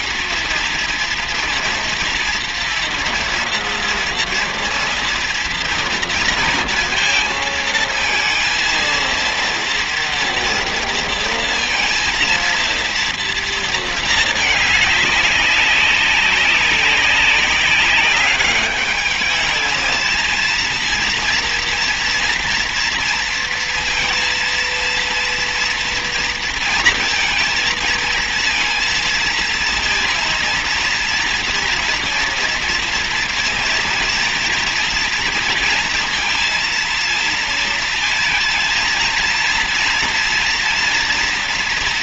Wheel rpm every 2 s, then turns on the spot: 230, 230, 230, 230, 230, 230, 230, 210, 200, 200, 230, 230, 230, 230, 230, 230, 230, 230, 230, 230, 230.
none